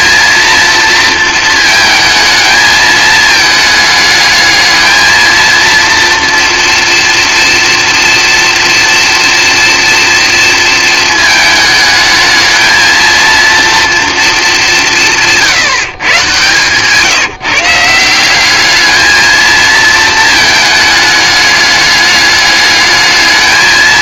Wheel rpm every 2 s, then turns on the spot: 230, 220, 220, 240, 240, 230, 220, 200, 140, 200, 220, 210.
none